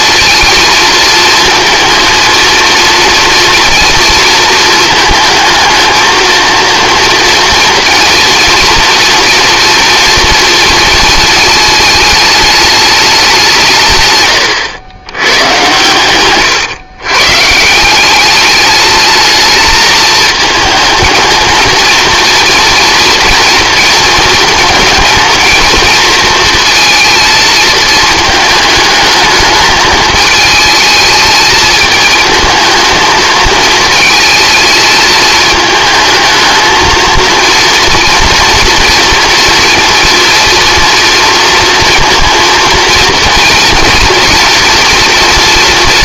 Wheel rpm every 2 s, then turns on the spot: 230, 230, 220, 230, 230, 230, 210, 110, 130, 210, 220, 230, 220, 230, 210, 220, 220, 220, 230, 230, 230, 230, 240.
none